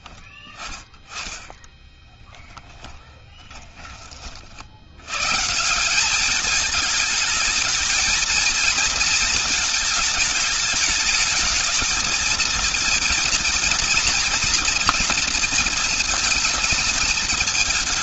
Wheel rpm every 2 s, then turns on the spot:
20, 10, 80, 210, 220, 210, 230, 230, 220.
0-4